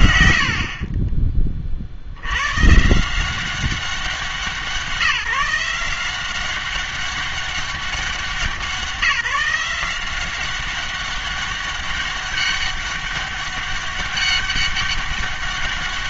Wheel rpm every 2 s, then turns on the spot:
70, 130, 170, 190, 190, 190, 200, 200.
none